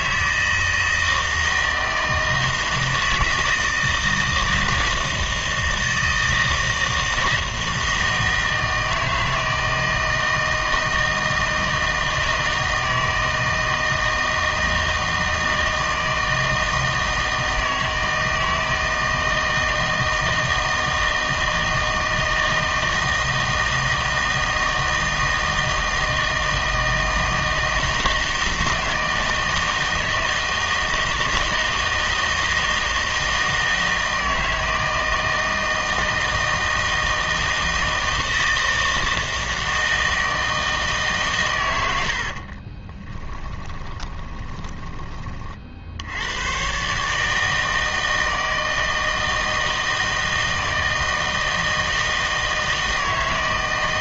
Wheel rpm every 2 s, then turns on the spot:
160, 160, 160, 160, 160, 160, 160, 160, 160, 160, 160, 160, 160, 160, 160, 160, 160, 160, 160, 160, 160, 30, 20, 120, 160, 160, 160.
42-46